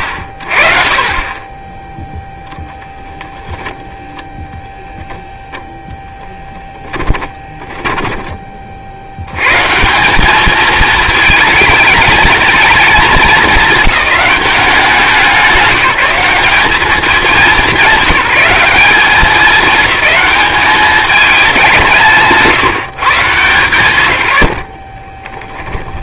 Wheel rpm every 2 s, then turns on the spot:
40, 0, 0, 10, 40, 210, 220, 180, 190, 190, 200, 160, 50.
6-8 24-26